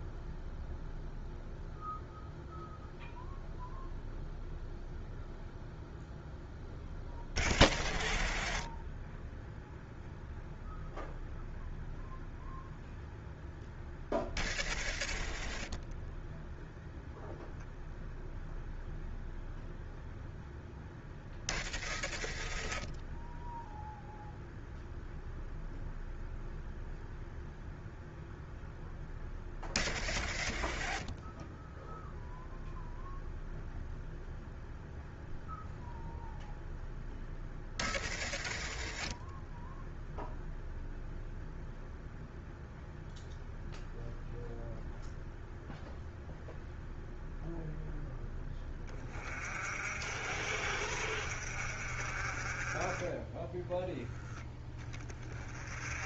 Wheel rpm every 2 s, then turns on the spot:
0, 0, 0, 0, 0, 0, 0, 0, 0, 0, 0, 0, 0, 0, 0, 0, 0, 0, 0, 0, 0, 0, 0, 0, 20, 50, 20, 20.
none